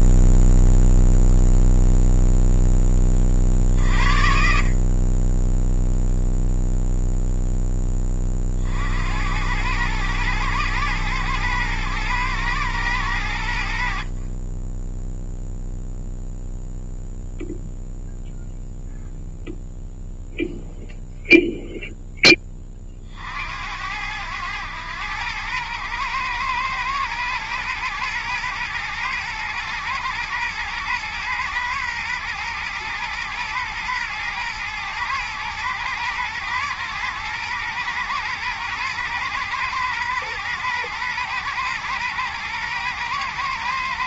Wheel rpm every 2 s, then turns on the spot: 0, 10, 40, 0, 60, 110, 110, 10, 0, 0, 0, 30, 100, 110, 120, 110, 120, 110, 110, 120, 110, 120.
none